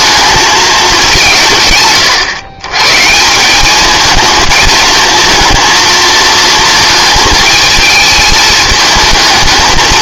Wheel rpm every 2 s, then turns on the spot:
210, 130, 220, 220, 210.
none